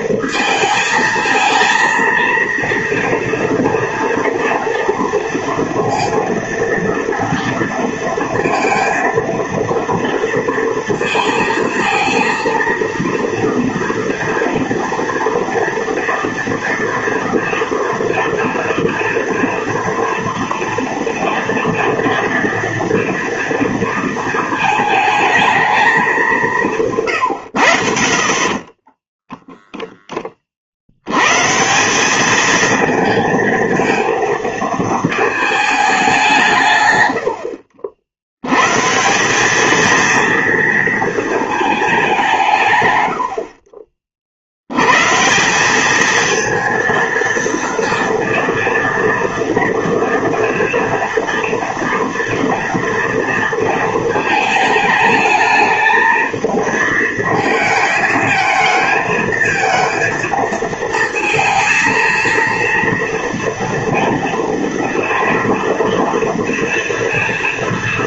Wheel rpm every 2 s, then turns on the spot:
220, 230, 230, 230, 230, 230, 230, 230, 230, 230, 230, 230, 220, 170, 40, 50, 220, 230, 150, 120, 230, 150, 80, 230, 230, 230, 230, 220, 220, 220, 220, 230, 230, 230.
28-30